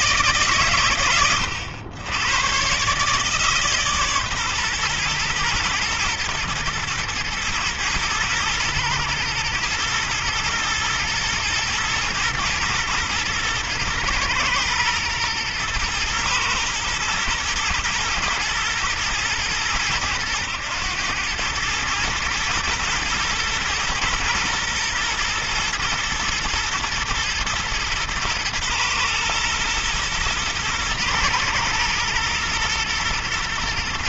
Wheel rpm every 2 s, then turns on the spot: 140, 120, 130, 110, 110, 120, 110, 120, 110, 120, 110, 120, 120, 110, 120, 110, 110.
none